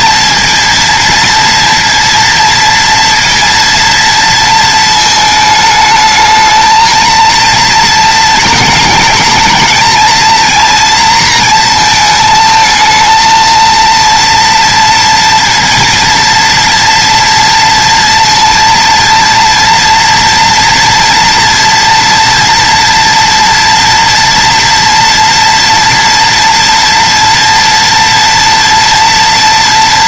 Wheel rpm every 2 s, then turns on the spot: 230, 230, 220, 230, 220, 230, 220, 230, 230, 230, 230, 230, 230, 230, 240.
none